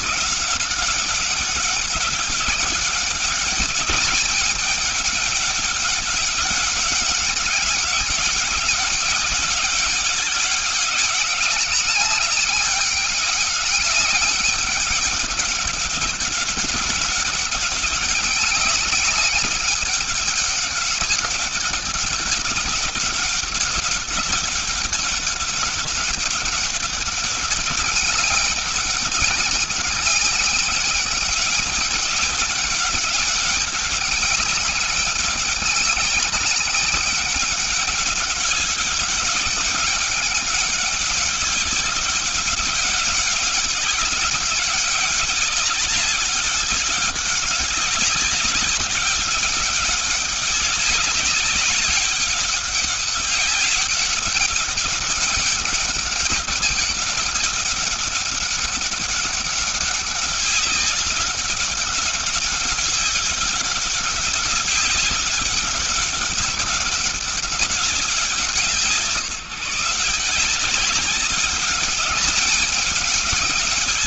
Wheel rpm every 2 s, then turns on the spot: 190, 200, 200, 200, 200, 190, 200, 190, 200, 200, 200, 200, 200, 200, 200, 200, 200, 200, 200, 200, 200, 200, 200, 190, 190, 200, 200, 200, 200, 200, 200, 200, 200, 200, 160, 200, 210.
none